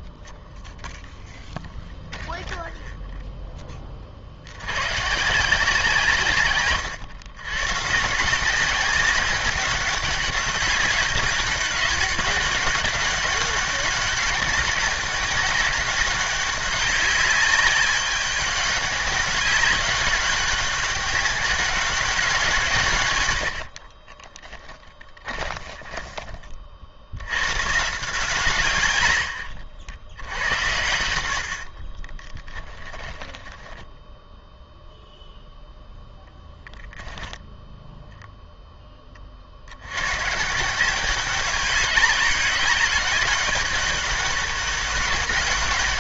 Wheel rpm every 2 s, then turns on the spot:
0, 0, 80, 130, 180, 190, 190, 200, 200, 200, 200, 170, 10, 40, 130, 100, 10, 0, 10, 0, 150, 200, 200.
24-26 32-34